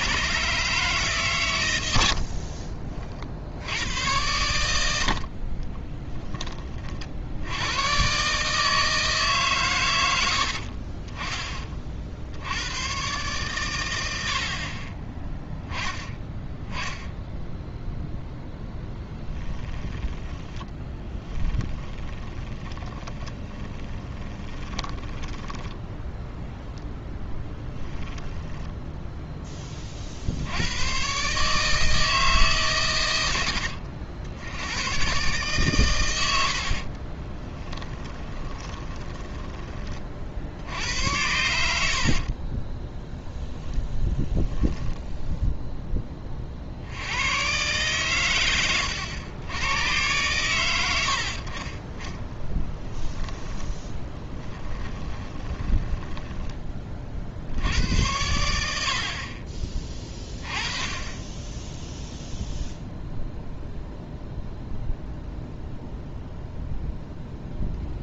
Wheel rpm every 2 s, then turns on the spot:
150, 40, 80, 20, 150, 50, 100, 40, 10, 0, 10, 20, 20, 0, 10, 90, 130, 110, 60, 10, 80, 10, 0, 60, 100, 100, 10, 10, 20, 70, 30, 0, 0, 0.
2-4 10-12 20-26 28-30 36-40 42-44 52-56